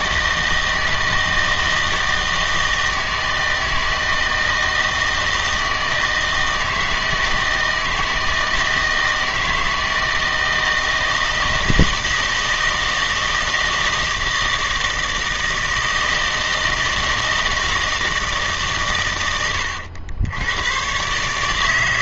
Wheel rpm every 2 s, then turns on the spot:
160, 160, 160, 160, 160, 160, 160, 160, 160, 150, 110.
none